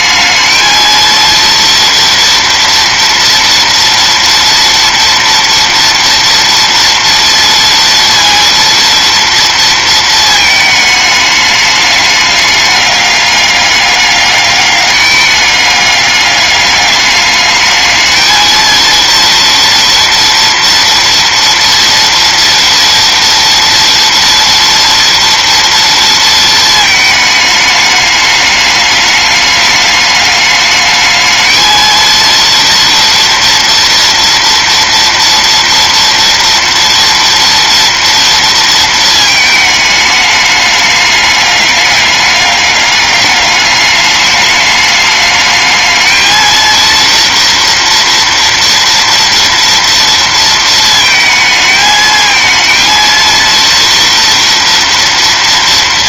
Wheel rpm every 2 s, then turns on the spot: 220, 240, 230, 230, 230, 220, 210, 200, 200, 230, 230, 230, 230, 220, 210, 210, 230, 230, 230, 230, 200, 200, 210, 230, 230, 220, 220, 230.
none